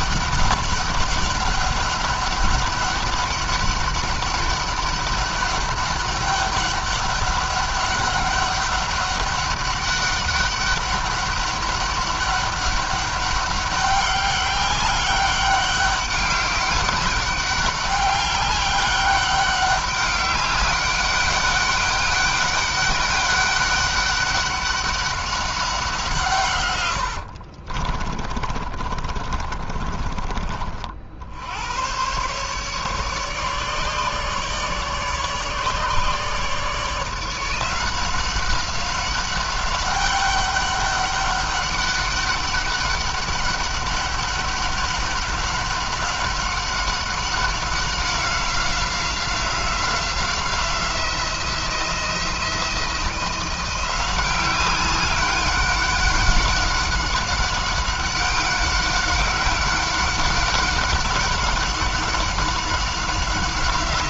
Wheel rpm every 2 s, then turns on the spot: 200, 200, 200, 200, 200, 200, 200, 200, 200, 200, 200, 200, 200, 100, 40, 50, 140, 150, 160, 190, 200, 200, 200, 190, 180, 180, 170, 190, 190, 200, 190, 190.
26-30